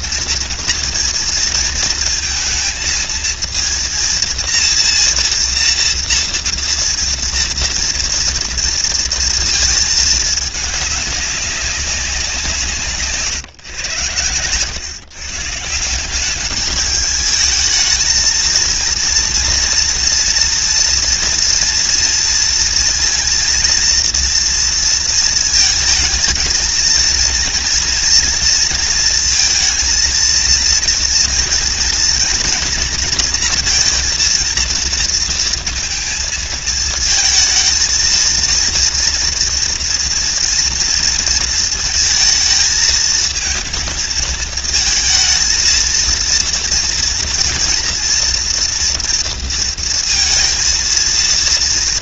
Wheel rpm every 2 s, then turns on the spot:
230, 230, 230, 230, 230, 210, 150, 140, 220, 230, 230, 230, 230, 230, 230, 230, 230, 230, 220, 230, 230, 220, 220, 240, 230, 230.
none